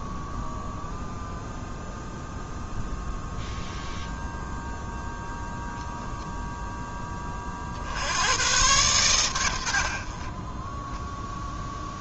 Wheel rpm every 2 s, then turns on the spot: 0, 0, 0, 10, 110, 10.
none